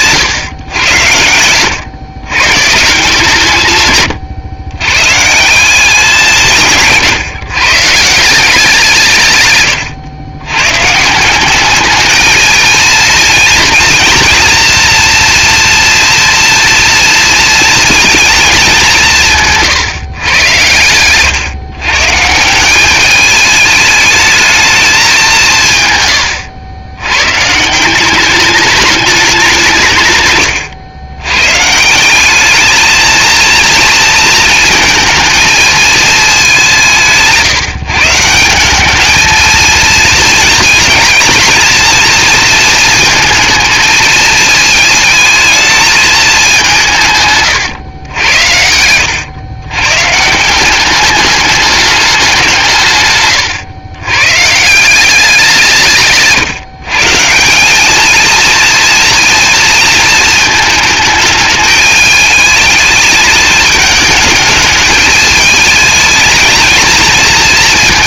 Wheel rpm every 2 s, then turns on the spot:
100, 150, 120, 160, 170, 130, 230, 240, 230, 190, 110, 200, 210, 120, 210, 100, 220, 220, 170, 200, 220, 230, 220, 180, 90, 190, 150, 180, 140, 230, 220, 210, 220, 220.
48-50